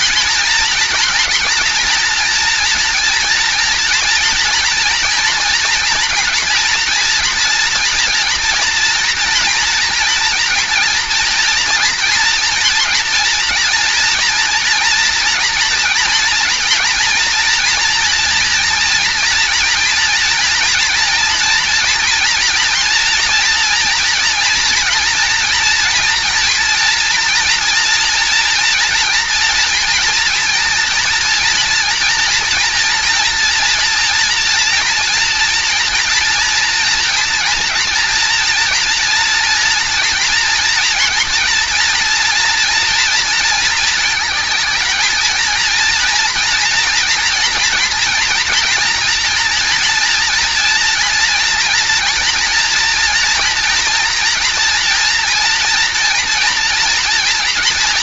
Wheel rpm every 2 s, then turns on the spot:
230, 230, 230, 230, 230, 230, 230, 230, 230, 240, 230, 230, 230, 230, 230, 230, 230, 230, 230, 240, 240, 230, 220, 230, 230, 230, 230, 230, 240.
none